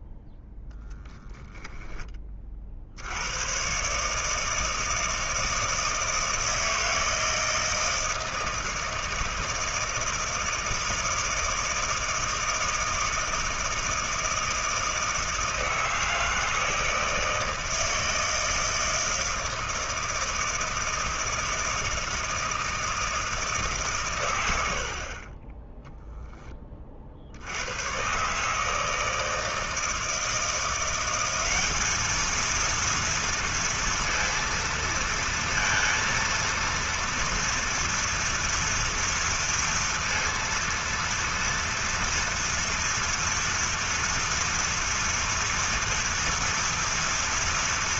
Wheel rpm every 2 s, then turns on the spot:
0, 70, 160, 160, 160, 160, 160, 160, 160, 160, 160, 160, 50, 40, 160, 180, 230, 230, 230, 230, 230, 230, 230, 230.
none